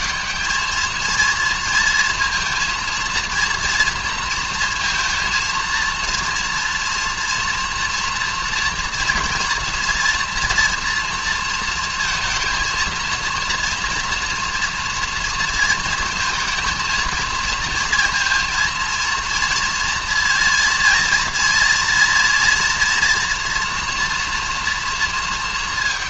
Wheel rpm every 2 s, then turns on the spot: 220, 230, 230, 230, 230, 230, 230, 230, 230, 230, 230, 230, 230.
none